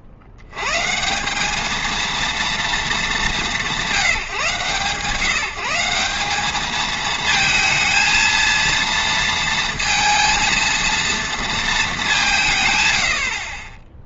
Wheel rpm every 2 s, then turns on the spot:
110, 230, 140, 210, 230, 230, 130.
none